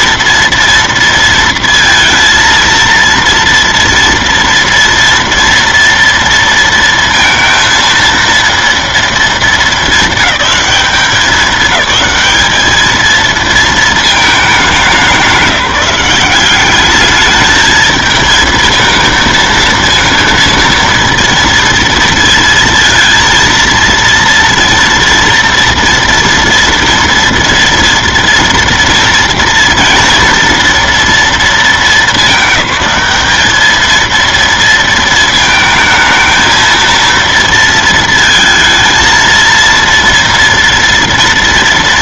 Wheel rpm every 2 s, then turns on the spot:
230, 230, 230, 230, 230, 200, 210, 210, 180, 220, 230, 230, 230, 230, 230, 230, 200, 230, 220, 220, 230.
none